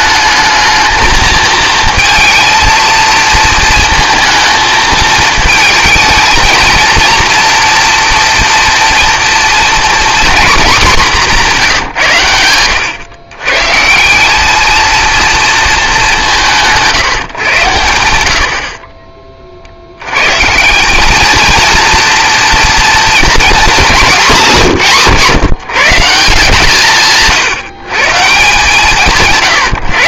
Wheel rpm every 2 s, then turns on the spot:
220, 230, 220, 230, 230, 220, 100, 220, 170, 50, 170, 230, 170, 160, 160.
none